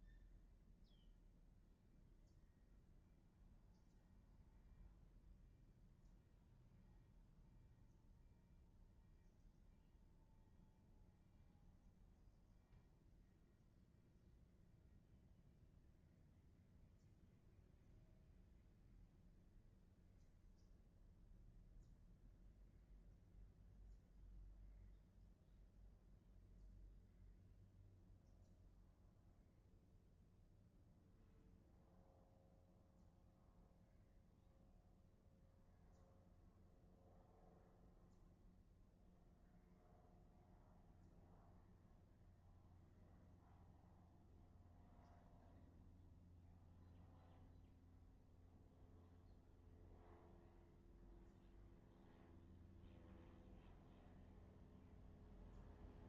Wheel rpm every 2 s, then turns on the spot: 0, 0, 0, 0, 0, 0, 0, 0, 0, 0, 0, 0, 0, 0, 0, 0, 0, 0, 0, 0, 0, 0, 0, 0, 0, 0, 0, 0.
none